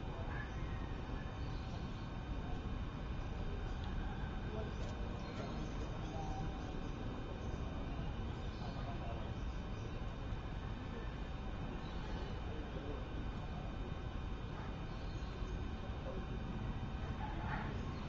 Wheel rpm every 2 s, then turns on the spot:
0, 0, 0, 0, 0, 0, 0, 0, 0.
none